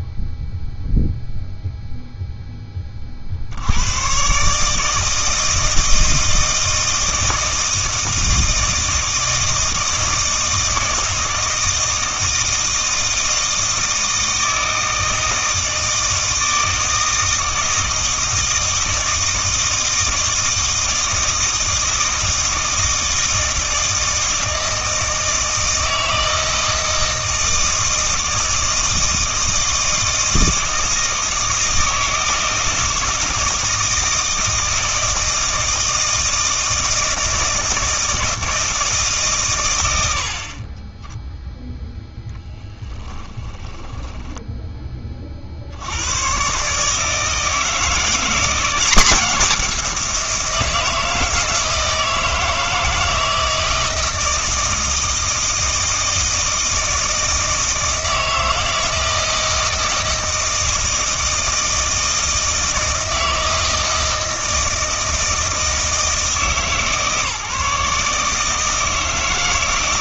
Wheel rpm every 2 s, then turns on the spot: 0, 10, 150, 160, 160, 160, 160, 160, 160, 160, 160, 160, 160, 160, 160, 160, 160, 160, 160, 160, 20, 10, 10, 140, 180, 170, 160, 160, 160, 160, 160, 160, 160, 150, 160.
42-44